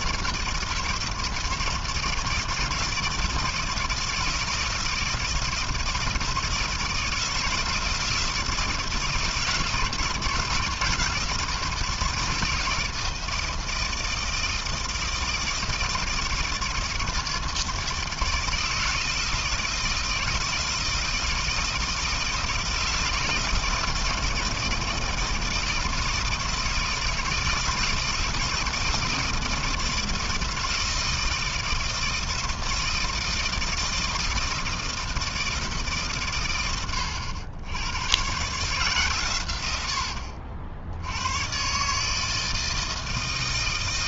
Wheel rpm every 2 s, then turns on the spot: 160, 160, 160, 160, 170, 170, 160, 160, 160, 160, 160, 160, 160, 160, 160, 160, 160, 160, 90, 130, 100, 160.
none